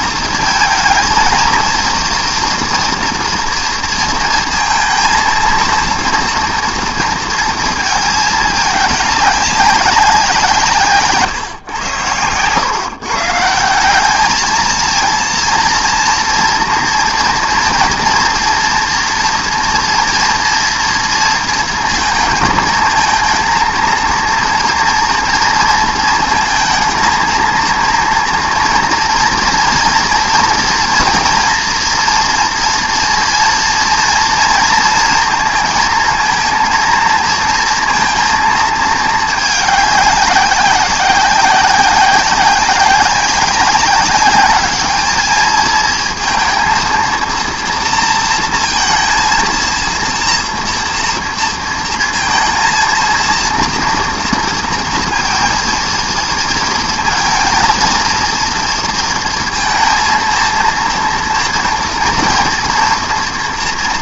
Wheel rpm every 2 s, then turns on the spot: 220, 230, 230, 230, 210, 160, 130, 230, 240, 240, 230, 230, 230, 230, 240, 230, 230, 230, 230, 220, 190, 190, 210, 230, 230, 240, 230, 230, 230, 230, 230, 230.
none